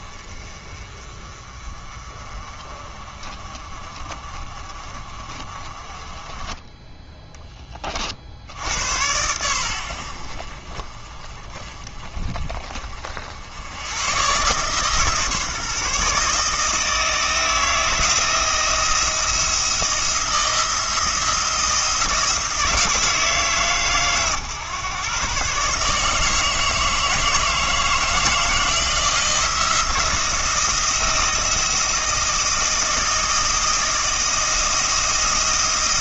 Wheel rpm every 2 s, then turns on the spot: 30, 30, 40, 10, 80, 40, 50, 150, 160, 170, 170, 160, 130, 160, 160, 170, 170, 170.
none